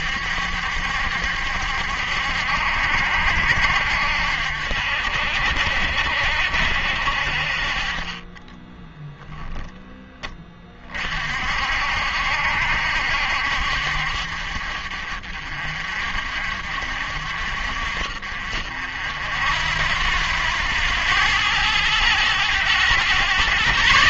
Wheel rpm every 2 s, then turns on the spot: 70, 70, 60, 60, 10, 30, 70, 50, 50, 60, 90, 110.
8-10